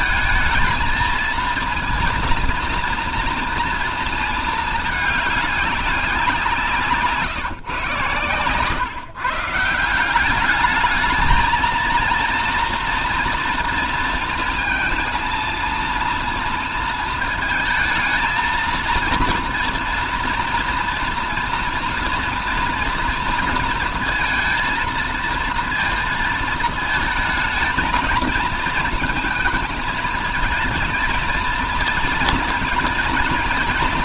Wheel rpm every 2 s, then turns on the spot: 220, 230, 220, 170, 140, 200, 230, 230, 230, 220, 240, 230, 230, 220, 220, 230, 230.
none